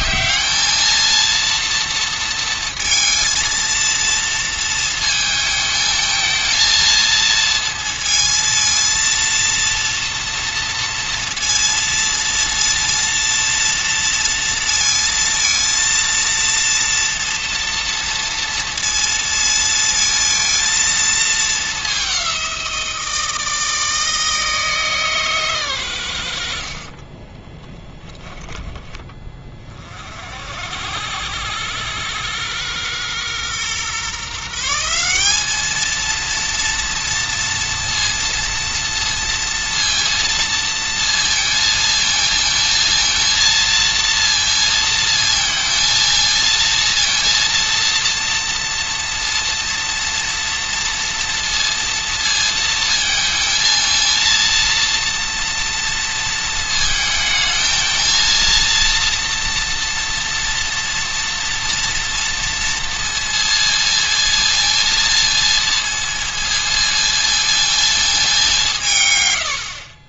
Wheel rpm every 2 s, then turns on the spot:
230, 230, 230, 230, 230, 230, 230, 230, 230, 230, 220, 170, 150, 30, 20, 80, 120, 180, 230, 230, 230, 230, 230, 230, 230, 230, 220, 230, 220, 230, 230, 230, 230, 230, 140.
26-28